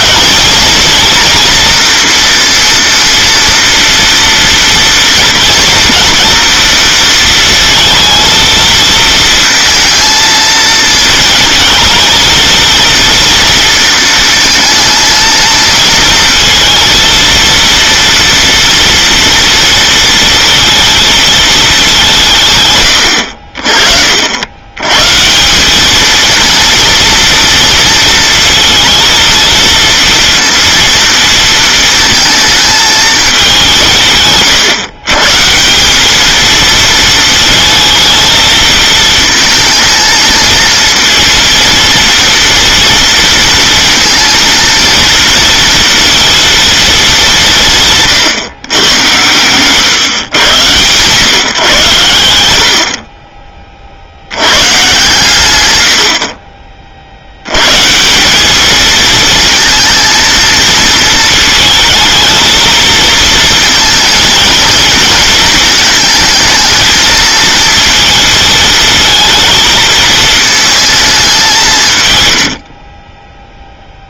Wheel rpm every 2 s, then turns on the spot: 240, 230, 230, 230, 230, 220, 230, 220, 230, 230, 230, 150, 90, 230, 230, 230, 220, 130, 220, 220, 220, 230, 230, 230, 140, 110, 70, 120, 40, 200, 230, 220, 230, 230, 230, 220, 80.
none